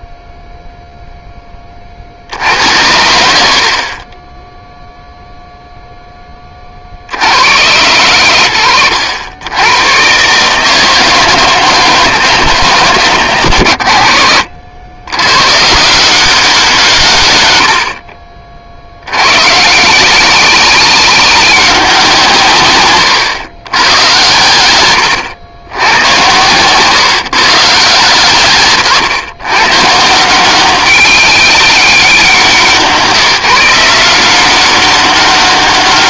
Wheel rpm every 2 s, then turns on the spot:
0, 60, 0, 10, 100, 160, 140, 80, 200, 30, 190, 130, 110, 120, 120, 190, 180, 190.
26-28